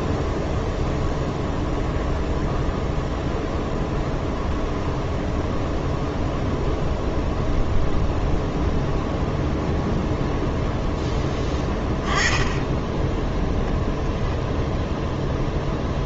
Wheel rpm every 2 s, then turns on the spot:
0, 0, 0, 0, 0, 0, 10, 0.
none